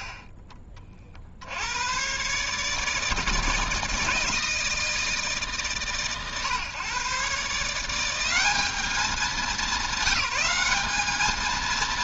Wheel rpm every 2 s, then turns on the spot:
30, 140, 160, 130, 190, 200.
none